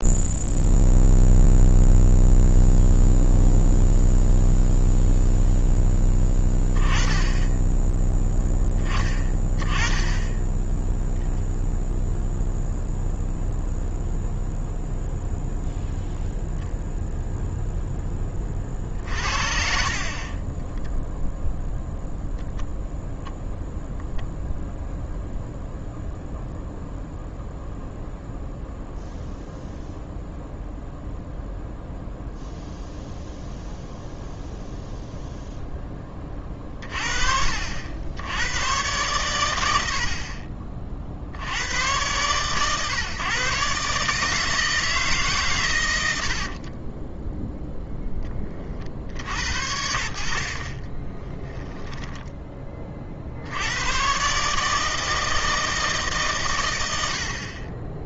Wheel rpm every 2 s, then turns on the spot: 0, 0, 0, 10, 10, 20, 0, 0, 0, 30, 20, 0, 0, 0, 0, 0, 0, 0, 30, 110, 40, 120, 160, 40, 30, 50, 20, 150, 110.
20-22 46-48 50-52